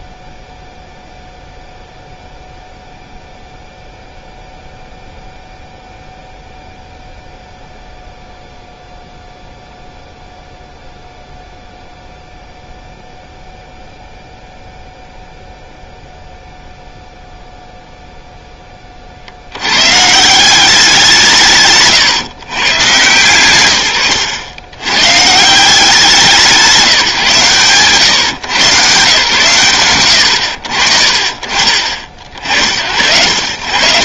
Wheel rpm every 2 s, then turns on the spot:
0, 0, 0, 0, 0, 0, 0, 0, 0, 30, 180, 120, 110, 160, 110, 60, 80.
none